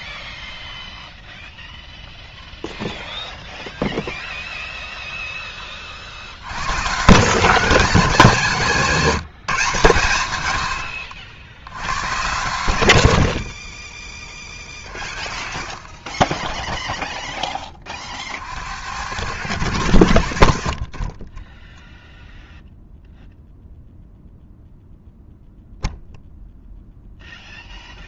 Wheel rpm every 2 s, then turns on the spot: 0, 0, 0, 130, 180, 90, 90, 30, 0, 80, 50, 0, 0, 0.
20-22